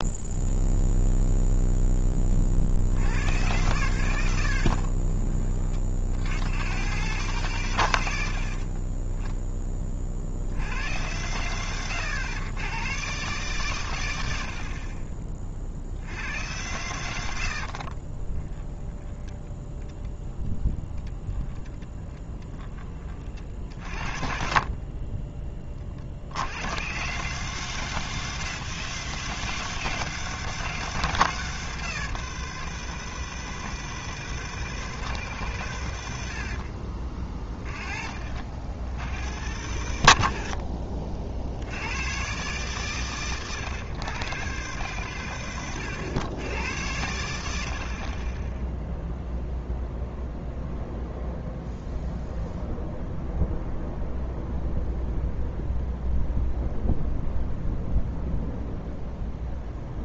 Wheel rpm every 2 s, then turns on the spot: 0, 100, 30, 120, 20, 100, 130, 30, 90, 20, 20, 40, 20, 130, 160, 160, 160, 150, 40, 100, 70, 120, 120, 90, 0, 0, 0, 0, 0, 0.
4-6 18-22 36-38